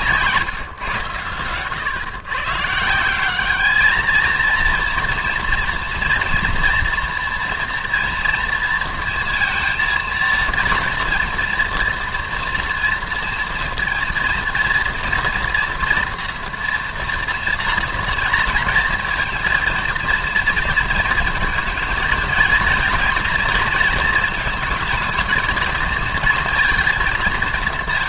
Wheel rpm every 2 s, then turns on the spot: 140, 140, 230, 240, 230, 230, 230, 230, 240, 230, 230, 230, 230, 230.
none